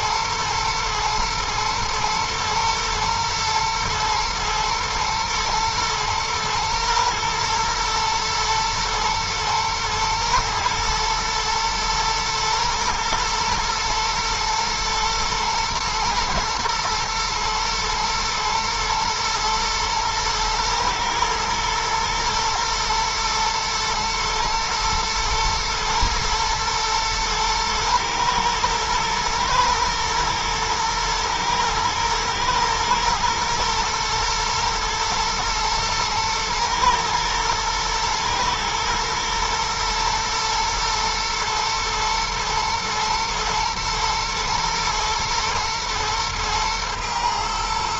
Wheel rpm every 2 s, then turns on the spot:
110, 110, 110, 110, 110, 110, 110, 110, 110, 110, 110, 120, 110, 110, 120, 110, 110, 110, 120, 120, 120, 110, 110, 110.
none